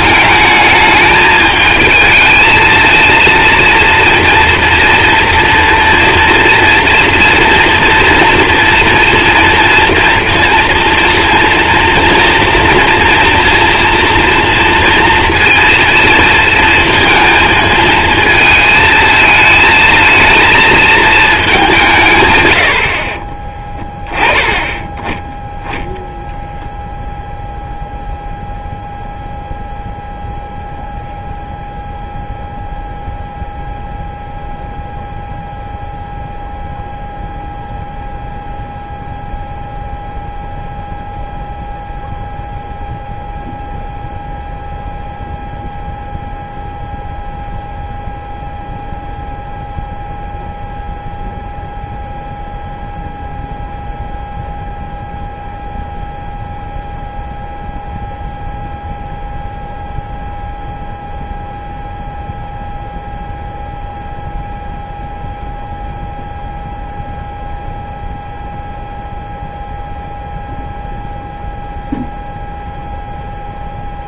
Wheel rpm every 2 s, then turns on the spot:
220, 220, 230, 230, 230, 230, 230, 230, 230, 220, 220, 110, 10, 0, 0, 0, 0, 0, 0, 0, 0, 0, 0, 0, 0, 0, 0, 0, 0, 0, 0, 0, 0, 0, 0, 0, 0.
none